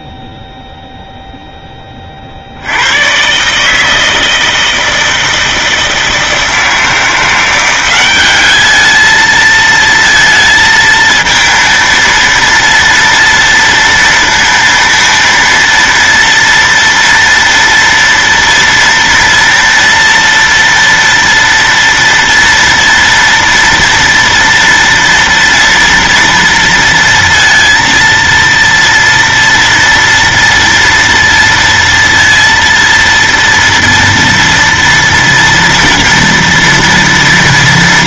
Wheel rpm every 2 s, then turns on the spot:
0, 30, 160, 160, 190, 230, 230, 230, 230, 230, 230, 230, 230, 230, 230, 230, 230, 230, 230.
none